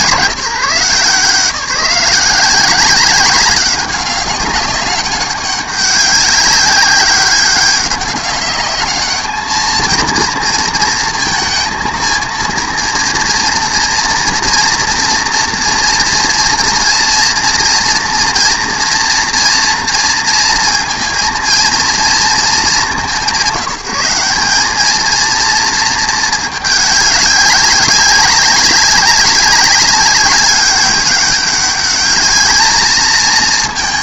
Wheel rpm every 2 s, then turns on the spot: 140, 190, 200, 200, 210, 230, 230, 230, 230, 240, 230, 220, 190, 210, 200, 200, 210.
none